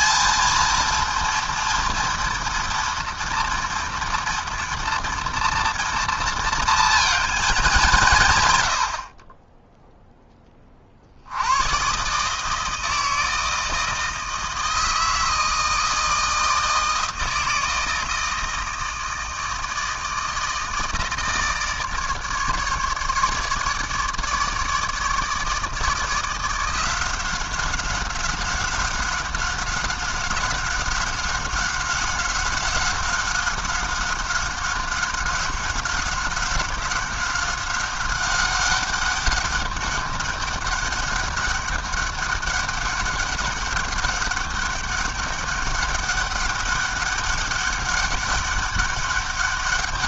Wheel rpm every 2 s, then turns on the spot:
230, 230, 230, 230, 100, 30, 160, 160, 160, 160, 160, 150, 150, 170, 190, 190, 190, 190, 190, 190, 200, 200, 200, 200, 200.
none